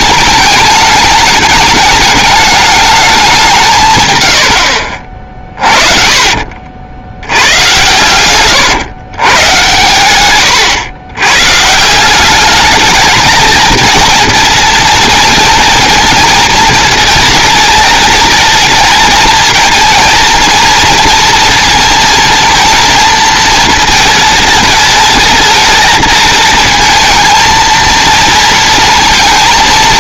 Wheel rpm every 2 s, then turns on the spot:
220, 210, 70, 70, 120, 120, 220, 240, 230, 220, 230, 230, 220, 220, 230.
4-6